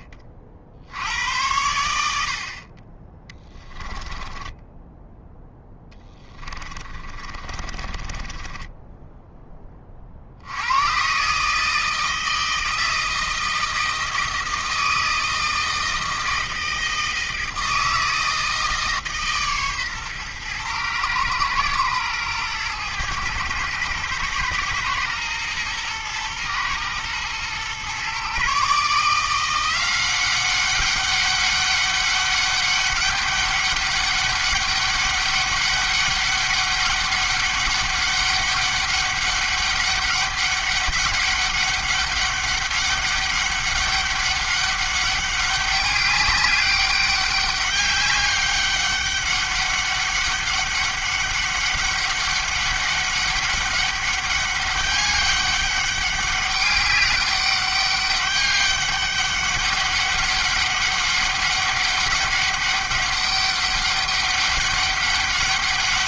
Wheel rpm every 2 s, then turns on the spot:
60, 40, 10, 30, 10, 90, 160, 160, 160, 160, 120, 120, 110, 110, 150, 200, 200, 200, 200, 200, 200, 200, 200, 200, 200, 200, 200, 200, 190, 200, 200, 200, 200.
4-10